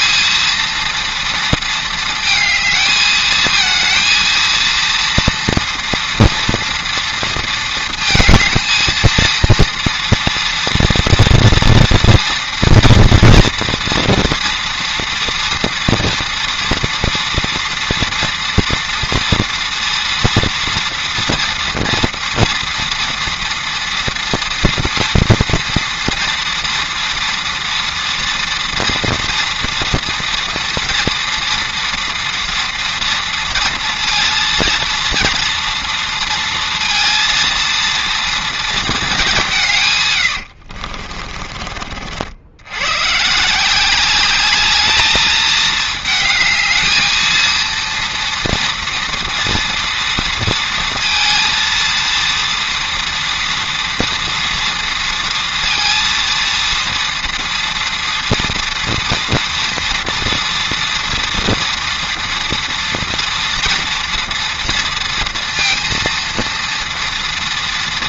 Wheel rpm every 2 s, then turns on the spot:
230, 220, 230, 230, 220, 230, 240, 230, 230, 230, 230, 230, 230, 230, 230, 230, 230, 230, 230, 230, 60, 100, 200, 220, 230, 230, 230, 230, 230, 230, 230, 230, 230, 230.
40-42